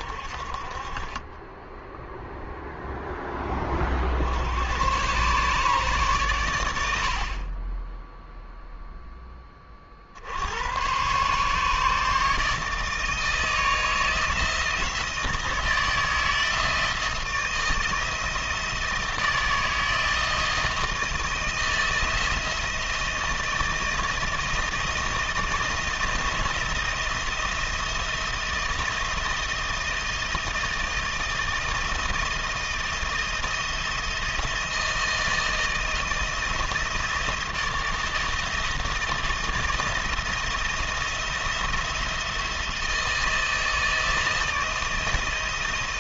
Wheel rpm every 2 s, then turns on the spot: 30, 10, 120, 50, 10, 130, 160, 160, 160, 160, 160, 160, 160, 170, 170, 170, 170, 160, 160, 170, 170, 160, 160.
none